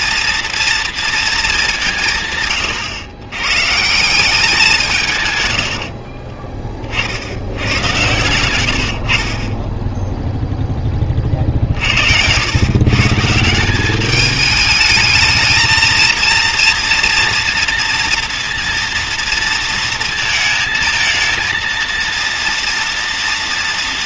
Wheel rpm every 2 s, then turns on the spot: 230, 140, 180, 20, 90, 0, 110, 210, 230, 230, 220, 230.
6-8